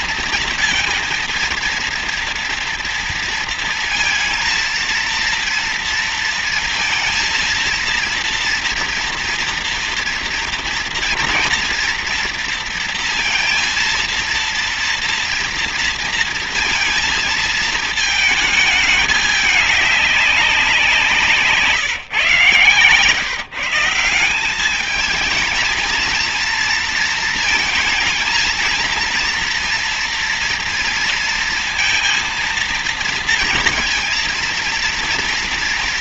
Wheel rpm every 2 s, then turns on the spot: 230, 230, 230, 220, 230, 230, 230, 230, 230, 210, 170, 130, 210, 230, 230, 230, 230, 230.
none